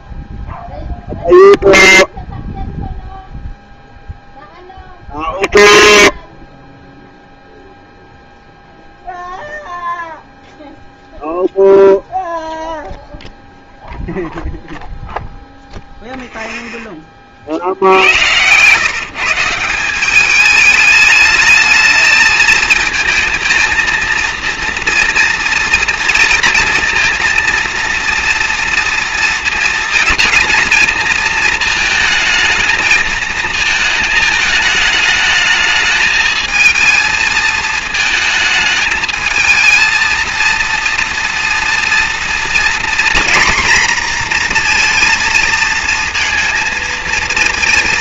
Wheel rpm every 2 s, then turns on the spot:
0, 0, 0, 0, 0, 0, 0, 0, 0, 120, 210, 220, 230, 230, 230, 230, 220, 220, 220, 220, 230, 240, 240, 230.
none